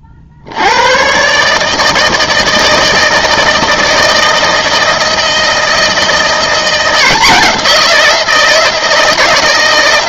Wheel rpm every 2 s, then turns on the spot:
70, 160, 160, 170, 170.
none